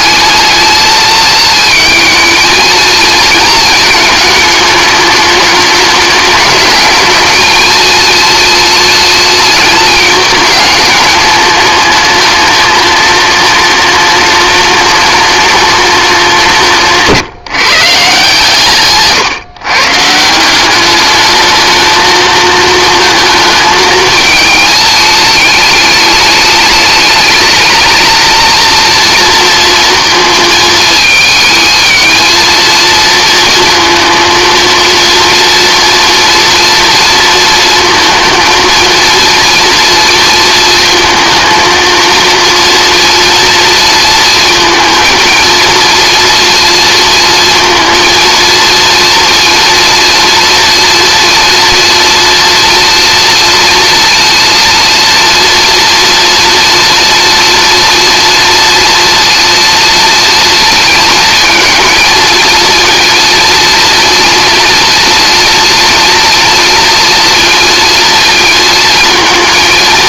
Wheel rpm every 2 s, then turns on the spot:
220, 230, 210, 210, 230, 210, 210, 210, 180, 150, 190, 230, 220, 210, 230, 220, 230, 230, 230, 230, 220, 230, 230, 230, 230, 230, 230, 230, 230, 230, 220, 230, 230, 230, 230.
none